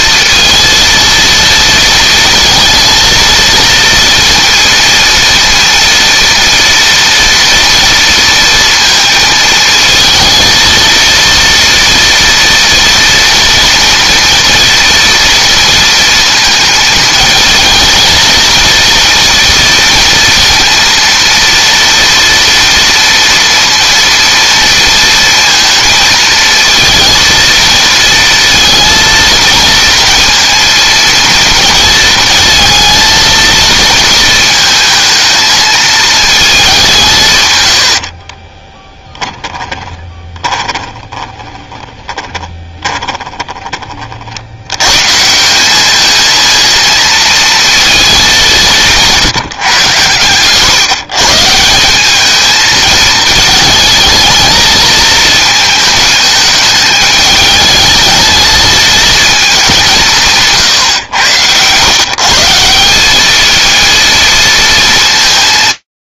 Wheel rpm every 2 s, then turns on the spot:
230, 230, 230, 230, 230, 230, 230, 230, 220, 230, 230, 230, 230, 230, 230, 230, 230, 220, 180, 10, 20, 10, 120, 230, 170, 140, 220, 220, 220, 220, 110, 190, 220.
38-44